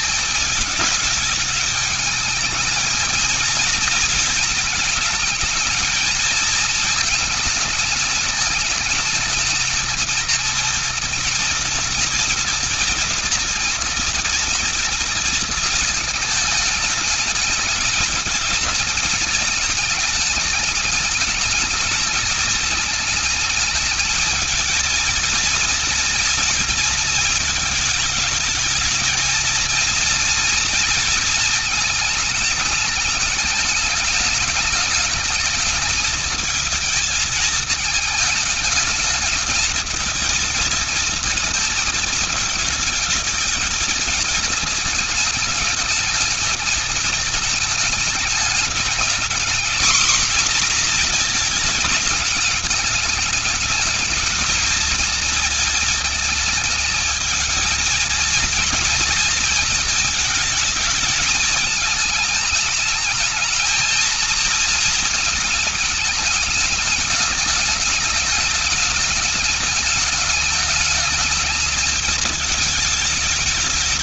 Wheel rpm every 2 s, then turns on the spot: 220, 220, 230, 220, 210, 230, 230, 230, 220, 220, 210, 220, 220, 230, 220, 230, 220, 210, 220, 210, 220, 220, 220, 210, 220, 250, 220, 220, 220, 230, 220, 210, 230, 210, 210, 210, 220.
none